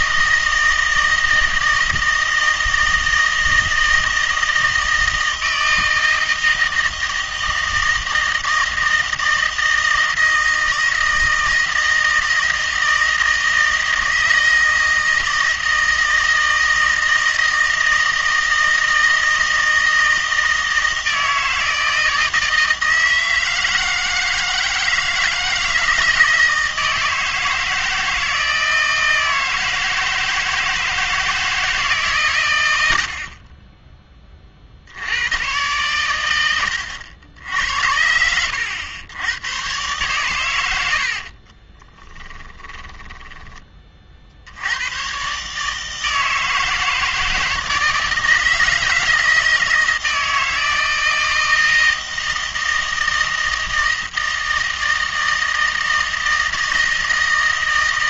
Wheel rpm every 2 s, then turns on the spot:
160, 160, 160, 160, 160, 160, 160, 160, 160, 160, 160, 160, 160, 160, 160, 160, 110, 40, 90, 90, 100, 10, 80, 160, 160, 160, 160, 160, 160.
42-44